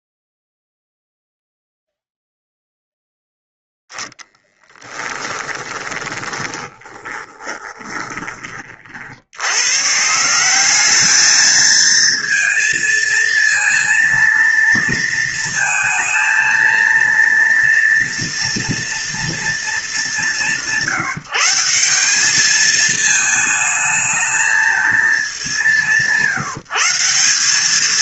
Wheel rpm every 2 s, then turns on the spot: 0, 0, 10, 20, 60, 210, 230, 230, 230, 230, 170, 220, 220, 190.
4-8